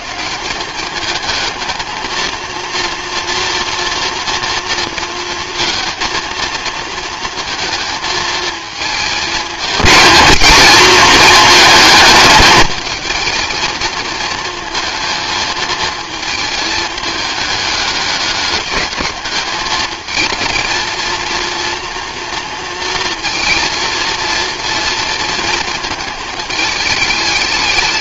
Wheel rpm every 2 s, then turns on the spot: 200, 230, 230, 230, 220, 230, 220, 220, 220, 200, 230, 230, 230, 210.
none